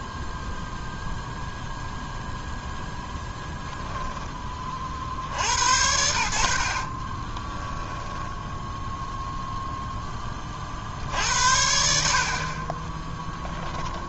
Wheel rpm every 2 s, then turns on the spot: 0, 0, 10, 60, 0, 30, 40.
6-8